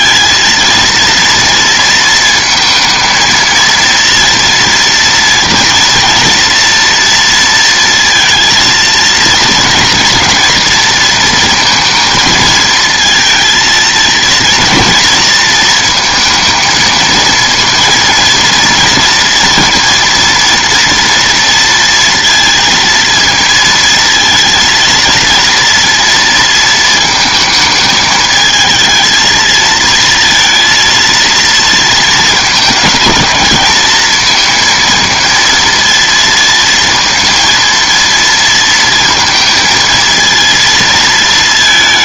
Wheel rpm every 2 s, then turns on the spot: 230, 230, 230, 230, 230, 230, 230, 230, 220, 230, 230, 230, 230, 230, 220, 230, 220, 230, 230, 230, 230.
none